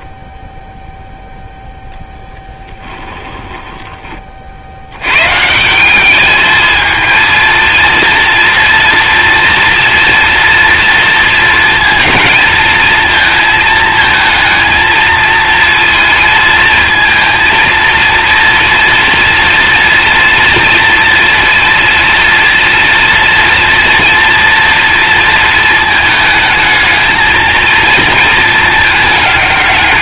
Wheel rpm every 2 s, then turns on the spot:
30, 0, 30, 210, 230, 230, 230, 220, 230, 230, 230, 230, 230, 220, 230.
none